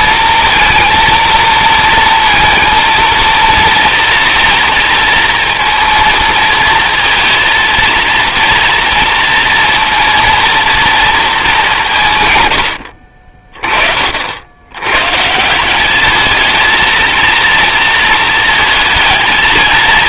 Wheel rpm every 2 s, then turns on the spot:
230, 230, 230, 230, 230, 230, 80, 100, 220, 230.
none